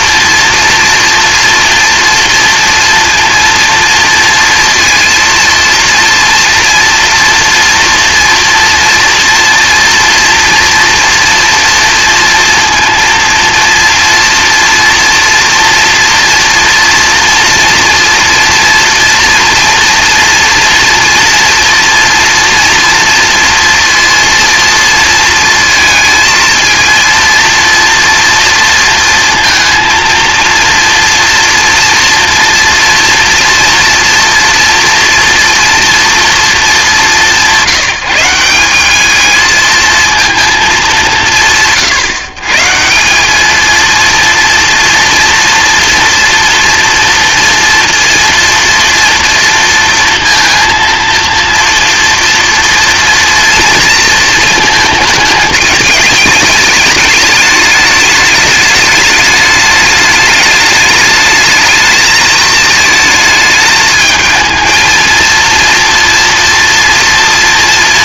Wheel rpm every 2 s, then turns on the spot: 230, 230, 230, 240, 230, 230, 230, 230, 230, 240, 230, 230, 230, 230, 230, 230, 240, 240, 220, 190, 220, 150, 230, 240, 230, 230, 230, 220, 210, 210, 210, 220, 220, 240.
none